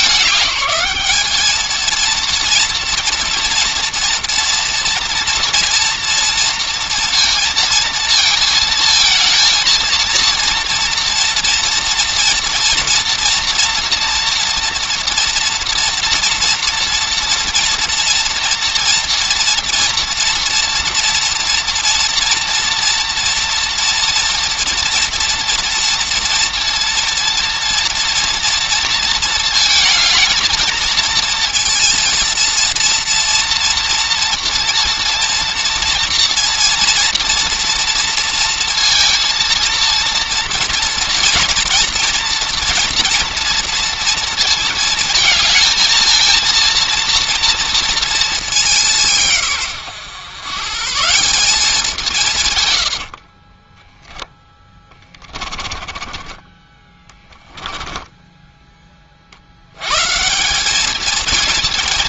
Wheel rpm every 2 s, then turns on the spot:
210, 230, 230, 230, 230, 230, 230, 240, 230, 230, 230, 230, 230, 230, 230, 220, 230, 230, 230, 230, 230, 240, 220, 230, 190, 140, 110, 10, 10, 10, 200.
52-56